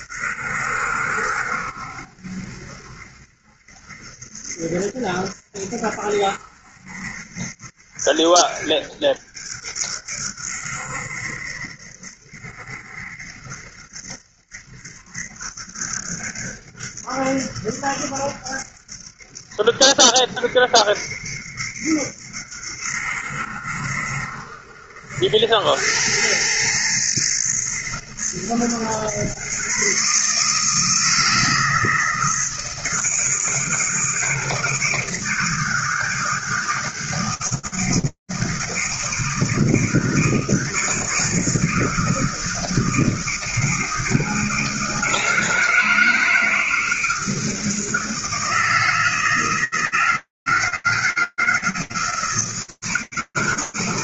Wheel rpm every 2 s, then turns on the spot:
70, 70, 70, 70, 70, 70, 70, 70, 70, 70, 60, 60, 70, 90, 110, 140, 160, 160, 160, 160, 160, 160, 170, 160, 160, 160, 160.
none